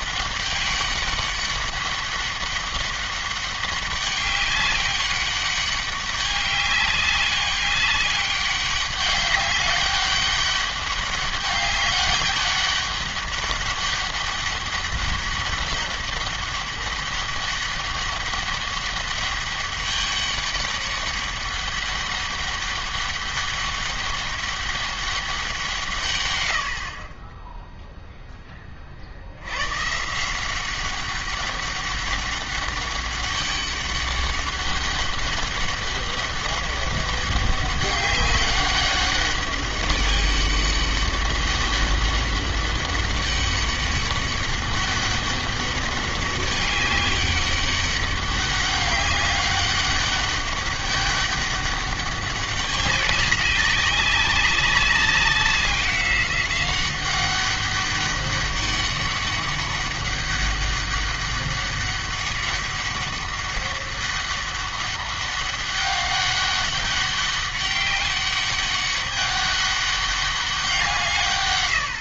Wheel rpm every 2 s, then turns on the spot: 200, 200, 200, 200, 200, 200, 200, 200, 200, 200, 200, 200, 200, 70, 20, 190, 200, 200, 200, 200, 200, 200, 200, 200, 200, 200, 200, 200, 190, 200, 200, 200, 200, 200, 200, 180.
none